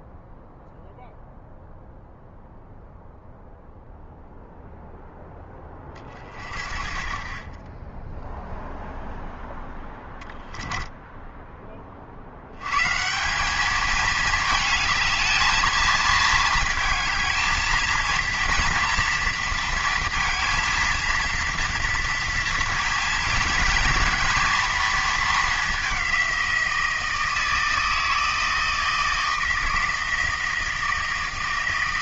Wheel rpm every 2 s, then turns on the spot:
0, 0, 0, 30, 0, 10, 110, 220, 220, 230, 230, 230, 230, 180, 160, 160.
10-12